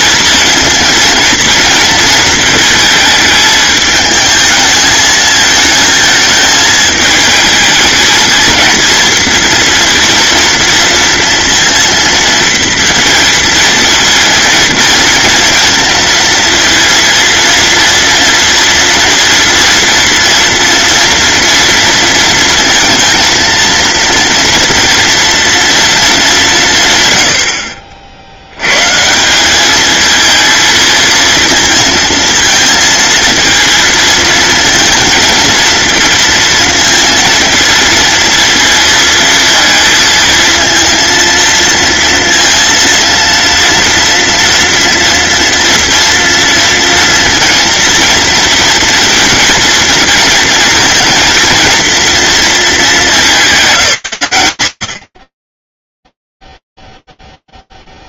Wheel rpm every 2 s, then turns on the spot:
230, 220, 220, 220, 230, 230, 230, 230, 230, 230, 230, 230, 230, 130, 130, 230, 230, 230, 230, 230, 230, 230, 230, 230, 230, 230, 210, 90, 0.
none